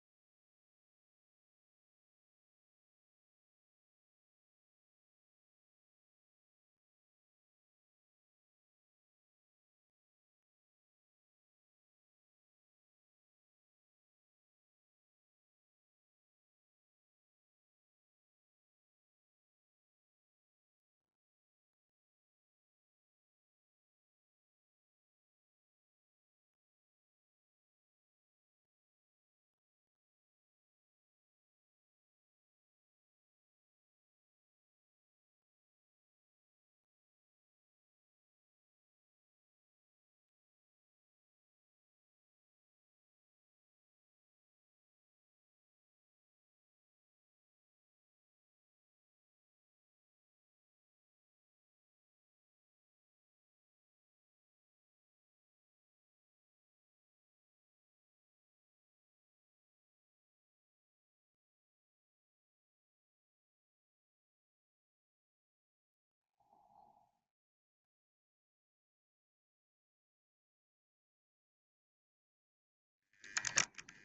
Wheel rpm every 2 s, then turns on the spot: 0, 0, 0, 0, 0, 0, 0, 0, 0, 0, 0, 0, 0, 0, 0, 0, 0, 0, 0, 0, 0, 0, 0, 0, 0, 0, 0, 0, 0, 0, 0, 0, 0, 0, 0, 0, 0.
none